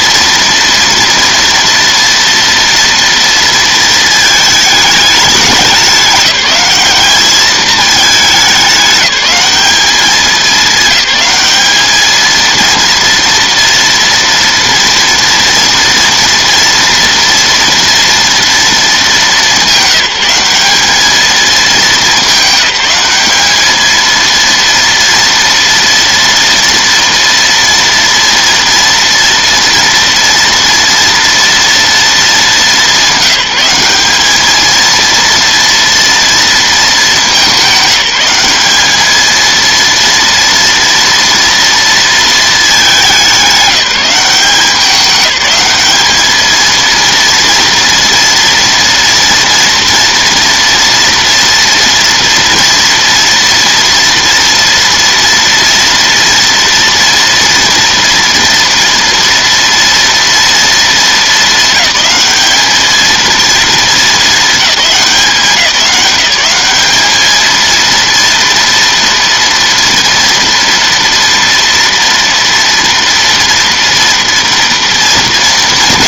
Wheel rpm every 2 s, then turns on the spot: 230, 230, 210, 210, 200, 210, 230, 240, 240, 220, 190, 200, 230, 230, 230, 230, 210, 220, 220, 210, 230, 200, 200, 230, 230, 240, 240, 230, 230, 230, 230, 220, 200, 210, 230, 230, 230, 230.
none